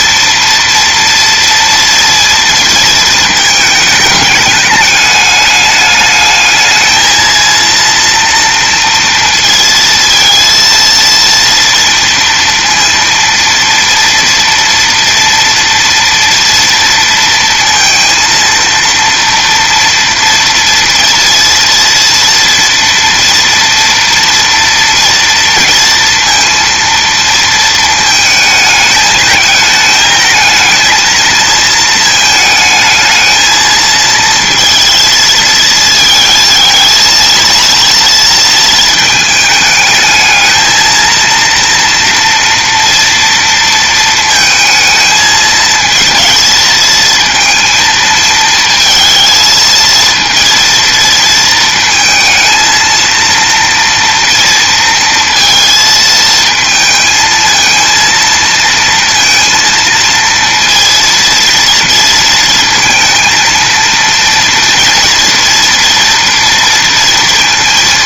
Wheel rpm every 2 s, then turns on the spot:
230, 230, 210, 220, 230, 230, 230, 230, 230, 230, 230, 230, 230, 230, 220, 220, 220, 230, 230, 220, 230, 230, 220, 230, 220, 230, 220, 230, 220, 230, 230, 230, 230, 230.
none